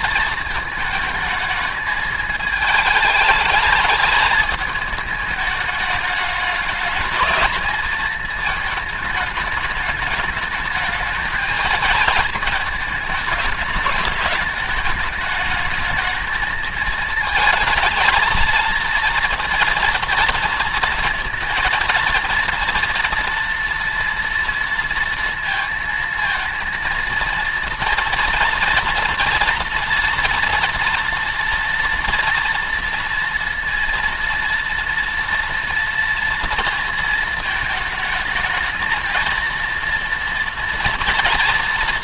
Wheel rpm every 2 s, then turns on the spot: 220, 220, 220, 210, 220, 220, 220, 220, 220, 230, 230, 230, 230, 230, 230, 230, 230, 230, 230, 220, 230.
none